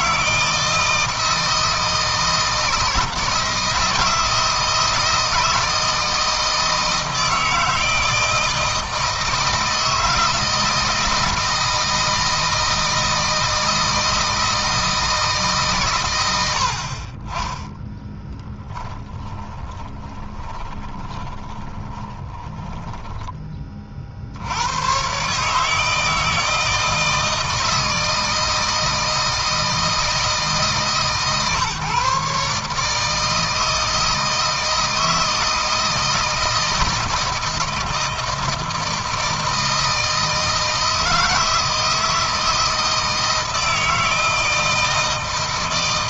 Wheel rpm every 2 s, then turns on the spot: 160, 160, 160, 160, 160, 160, 160, 160, 50, 20, 20, 10, 100, 160, 160, 140, 150, 160, 160, 160, 160, 160, 160.
18-24